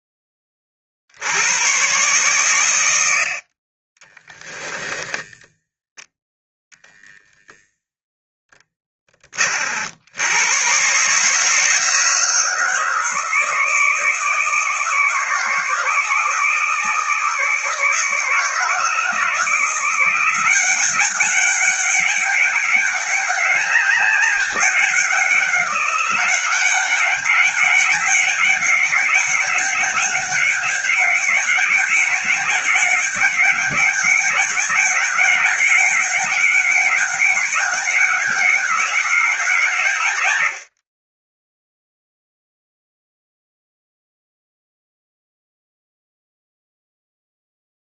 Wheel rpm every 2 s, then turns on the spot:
70, 90, 10, 0, 20, 140, 160, 160, 160, 160, 200, 200, 190, 200, 200, 200, 200, 200, 200, 190, 30, 0, 0, 0.
none